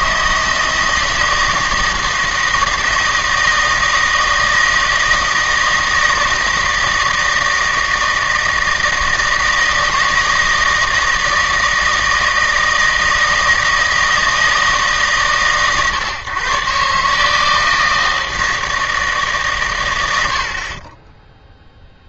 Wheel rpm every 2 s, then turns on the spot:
160, 160, 160, 160, 160, 160, 160, 160, 140, 160, 40.
none